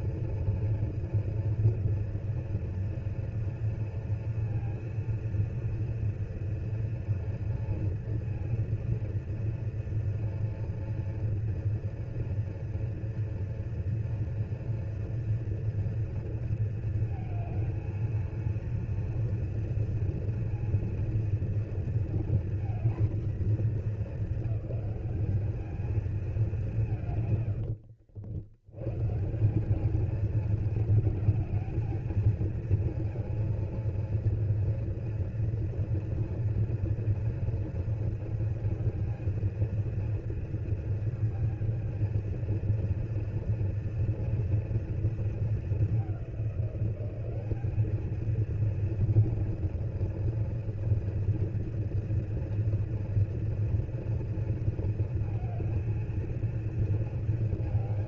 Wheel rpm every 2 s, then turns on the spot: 230, 230, 230, 230, 230, 230, 240, 230, 230, 230, 230, 240, 200, 180, 90, 220, 230, 230, 230, 220, 230, 230, 230, 190, 220, 230, 230, 230, 230.
none